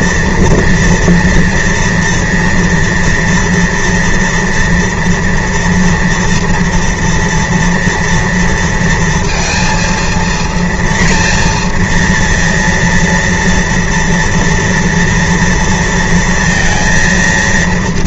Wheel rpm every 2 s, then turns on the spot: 240, 230, 240, 230, 230, 230, 230, 230, 230.
none